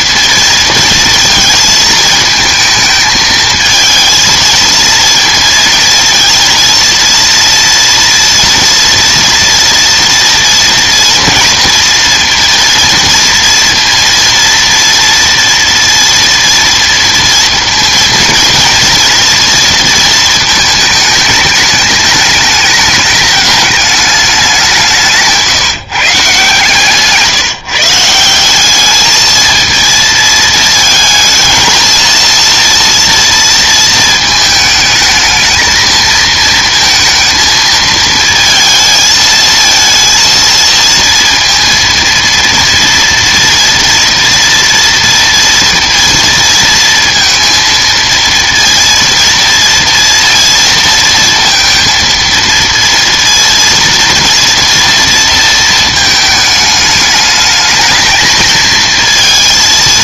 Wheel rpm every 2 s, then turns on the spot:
230, 220, 230, 230, 230, 230, 230, 230, 230, 230, 220, 210, 190, 140, 190, 220, 230, 220, 220, 220, 230, 230, 230, 230, 230, 230, 230, 230, 210, 220.
none